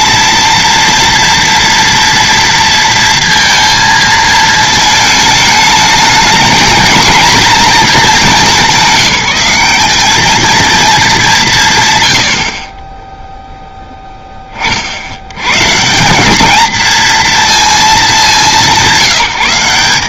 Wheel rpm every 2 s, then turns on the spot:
230, 230, 220, 220, 180, 220, 40, 30, 220, 190.
none